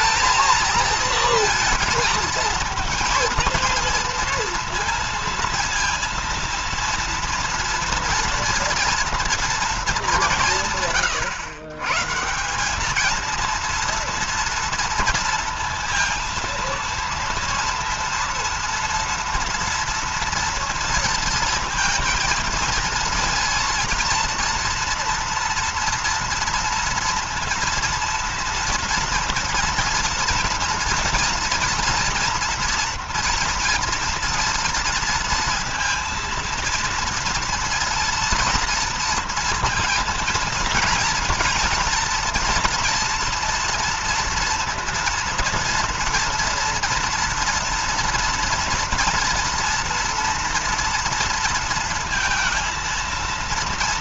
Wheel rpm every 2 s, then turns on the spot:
220, 230, 230, 230, 230, 180, 180, 230, 230, 230, 230, 230, 230, 230, 230, 230, 230, 230, 230, 230, 230, 230, 230, 230, 230, 230, 230.
none